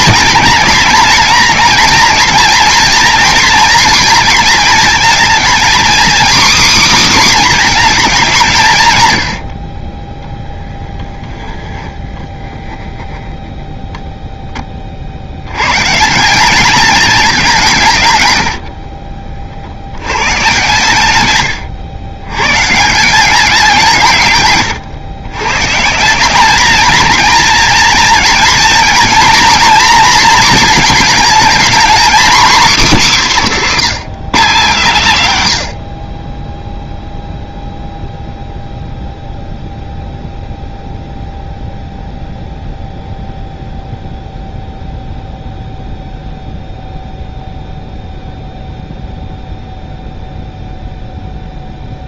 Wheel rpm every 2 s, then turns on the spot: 220, 230, 230, 270, 150, 0, 10, 30, 210, 80, 120, 140, 130, 210, 230, 230, 260, 170, 0, 0, 0, 0, 0, 0, 0, 0.
18-20